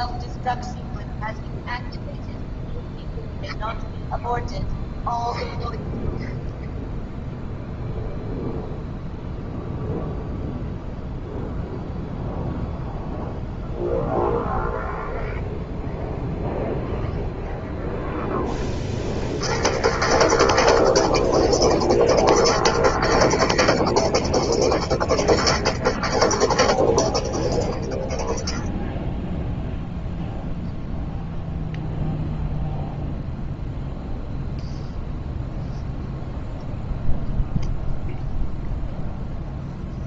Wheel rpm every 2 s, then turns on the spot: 0, 0, 0, 0, 0, 0, 0, 0, 0, 0, 0, 0, 0, 0, 0, 0, 0, 0, 0, 0.
none